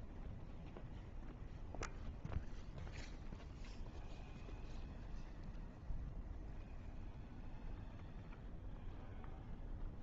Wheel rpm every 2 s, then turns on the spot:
0, 0, 0, 0, 0.
none